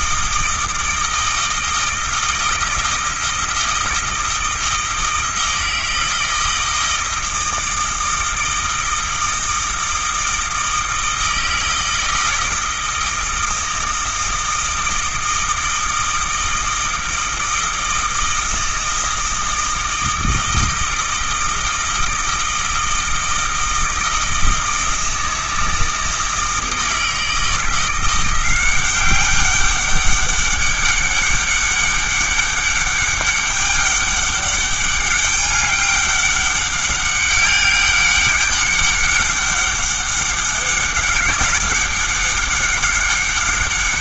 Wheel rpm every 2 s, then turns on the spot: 160, 160, 160, 160, 160, 160, 160, 160, 160, 160, 160, 160, 160, 160, 190, 200, 200, 200, 200, 200, 190, 200.
none